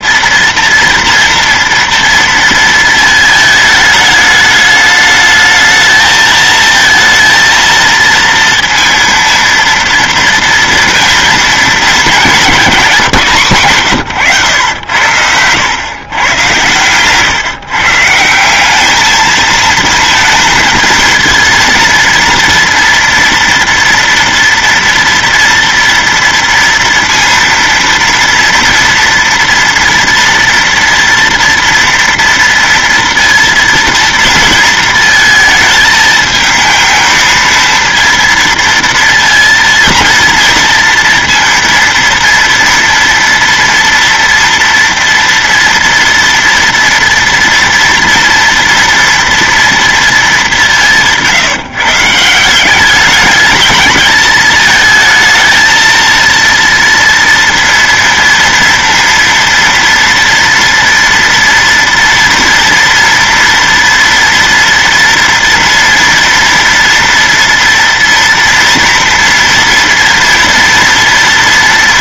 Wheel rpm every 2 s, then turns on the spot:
230, 230, 220, 220, 230, 230, 210, 110, 110, 170, 230, 230, 230, 230, 240, 230, 230, 230, 220, 230, 230, 230, 230, 230, 230, 190, 170, 210, 230, 230, 230, 230, 230, 230, 240, 240.
none